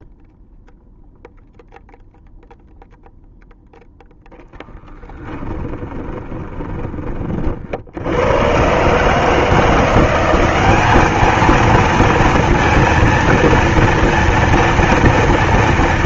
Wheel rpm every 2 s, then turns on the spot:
0, 0, 10, 20, 100, 200, 230, 230.
6-8